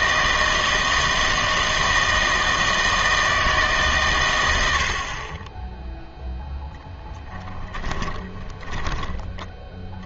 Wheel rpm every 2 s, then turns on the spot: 160, 160, 90, 0, 10.
8-10